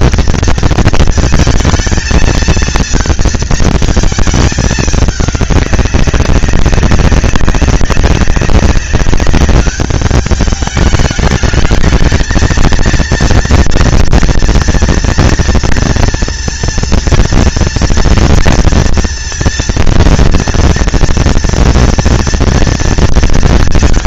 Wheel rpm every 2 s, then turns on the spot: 230, 220, 220, 190, 190, 210, 220, 230, 230, 230, 230, 230.
none